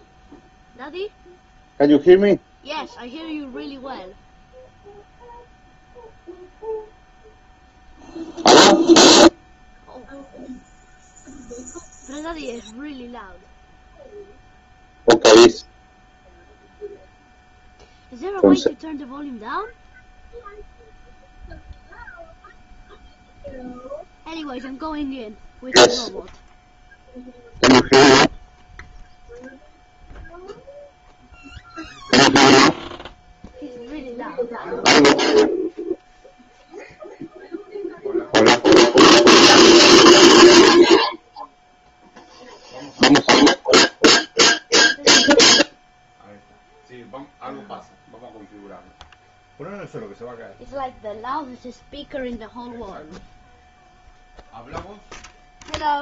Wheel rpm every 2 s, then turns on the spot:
0, 0, 0, 0, 0, 0, 0, 0, 0, 0, 0, 0, 0, 0, 0, 0, 0, 0, 0, 0, 0, 0, 0, 0, 0, 0, 0, 0.
none